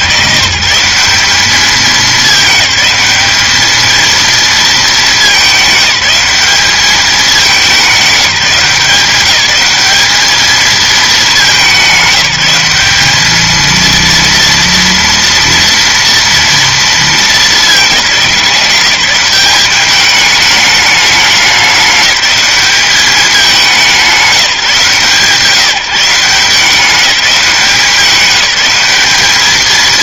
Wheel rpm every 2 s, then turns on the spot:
150, 210, 220, 210, 190, 220, 190, 230, 230, 180, 210, 200, 160, 180, 190.
none